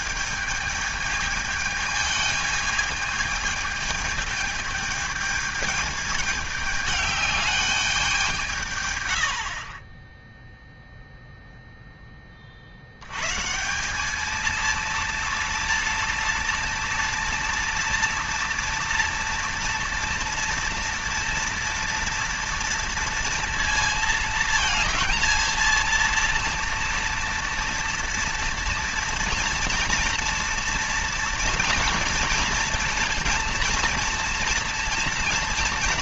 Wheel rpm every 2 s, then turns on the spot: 210, 220, 210, 210, 110, 0, 80, 230, 230, 230, 230, 230, 230, 230, 230, 230, 230, 230.
none